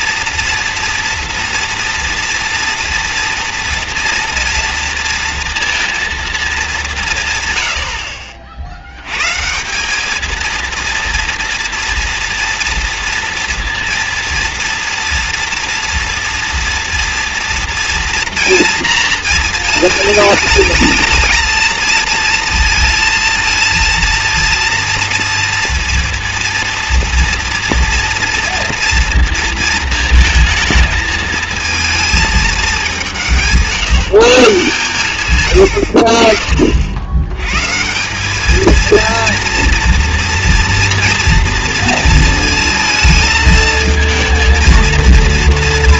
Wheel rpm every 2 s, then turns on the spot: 230, 230, 230, 220, 50, 230, 230, 230, 230, 230, 220, 230, 230, 230, 230, 220, 220, 140, 50, 200, 240, 230, 230.
none